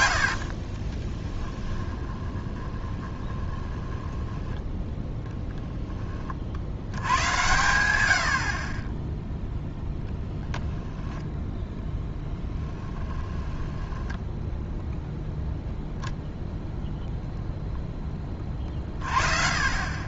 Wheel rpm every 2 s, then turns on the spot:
40, 20, 10, 90, 40, 0, 10, 0, 0, 30.
0-4 12-14